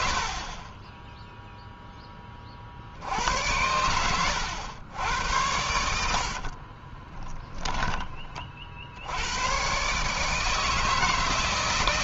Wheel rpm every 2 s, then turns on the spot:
40, 50, 100, 50, 40, 150.
0-2 6-8